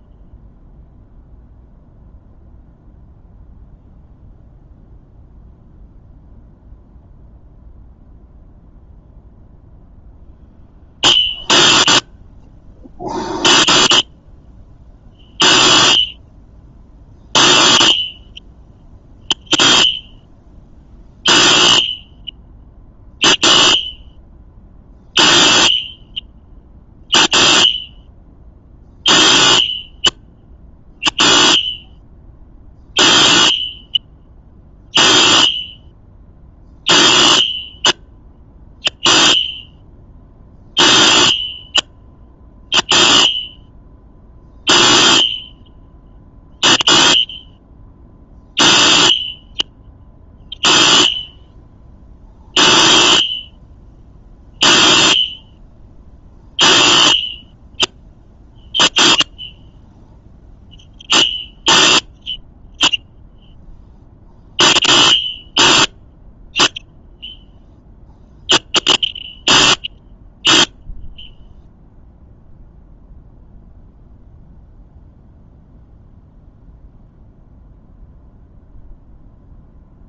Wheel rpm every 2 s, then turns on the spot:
0, 0, 0, 0, 0, 0, 0, 0, 0, 0, 0, 0, 0, 0, 0, 0, 0, 0, 0, 0, 0, 0, 0, 0, 0, 0, 0, 0, 0, 0, 0, 0, 0, 0, 0, 0, 0, 0, 0, 0.
none